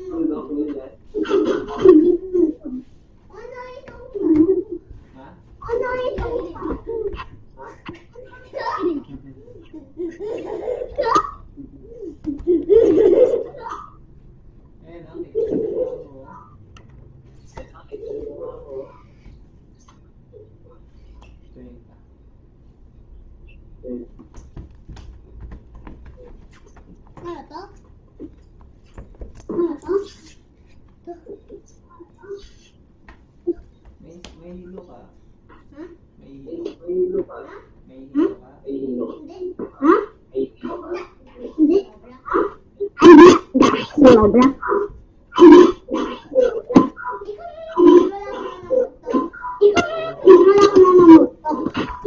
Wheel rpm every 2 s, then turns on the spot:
0, 0, 0, 0, 0, 0, 0, 0, 0, 0, 0, 0, 0, 0, 0, 0, 0, 0, 0, 0, 0, 0, 0, 0, 0, 0.
none